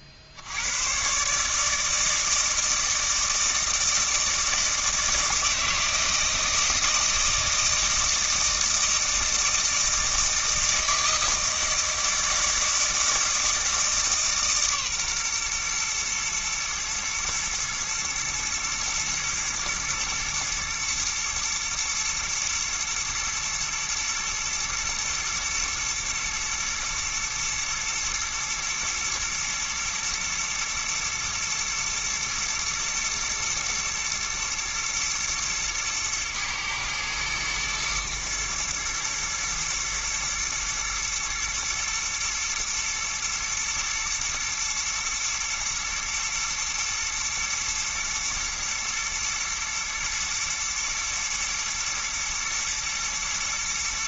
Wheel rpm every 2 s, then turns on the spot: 70, 160, 160, 160, 160, 160, 160, 140, 110, 120, 120, 120, 120, 110, 120, 110, 110, 120, 110, 110, 120, 120, 110, 110, 110, 110, 110.
none